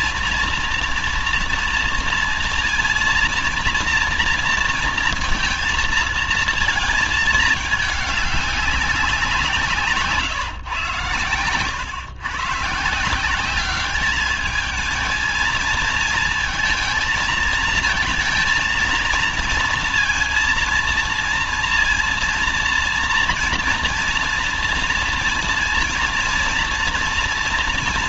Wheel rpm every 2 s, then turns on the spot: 230, 230, 230, 230, 200, 120, 140, 210, 220, 230, 230, 230, 230, 230.
none